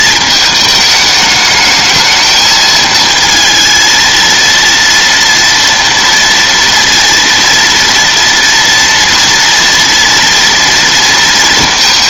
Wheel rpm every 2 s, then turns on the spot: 220, 220, 230, 230, 240, 230.
none